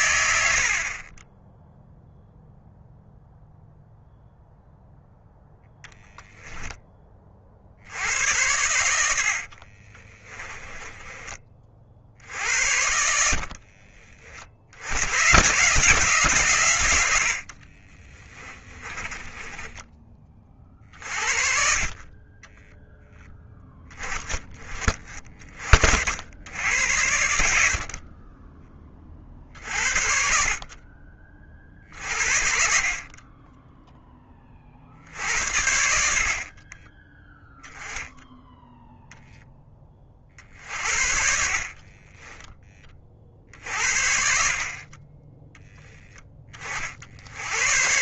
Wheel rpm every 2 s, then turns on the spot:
50, 0, 0, 10, 80, 20, 70, 80, 100, 20, 40, 0, 20, 90, 20, 40, 40, 50, 30, 0, 50, 20, 40, 40.
0-2 10-14 18-20 36-38 40-42